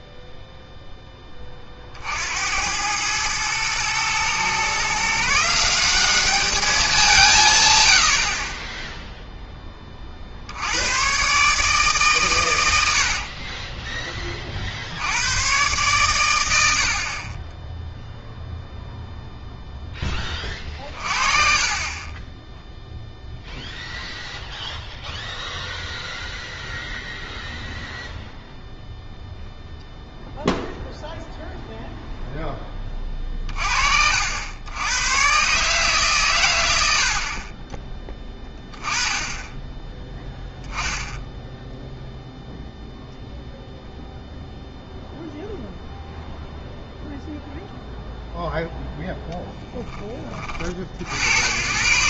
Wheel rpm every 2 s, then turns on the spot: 0, 90, 130, 200, 30, 70, 100, 50, 90, 0, 30, 0, 0, 0, 0, 0, 10, 90, 90, 20, 0, 0, 0, 0, 0, 40.
none